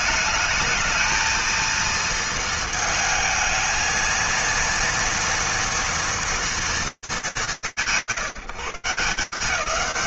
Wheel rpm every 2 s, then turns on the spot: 220, 220, 230, 210, 160.
none